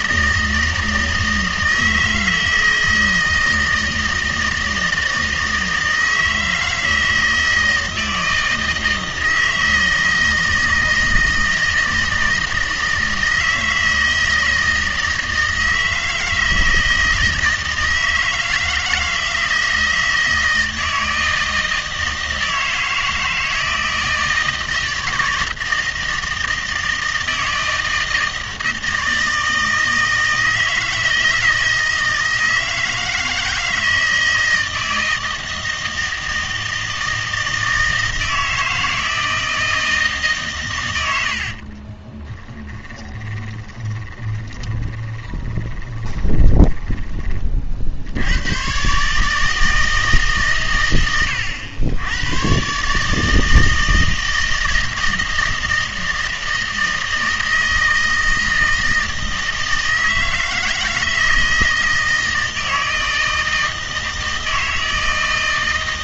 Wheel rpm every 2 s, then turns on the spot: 160, 160, 160, 160, 160, 160, 160, 160, 160, 160, 160, 160, 160, 160, 160, 160, 160, 160, 160, 160, 130, 20, 20, 20, 110, 130, 130, 160, 160, 160, 160, 160, 160.
42-48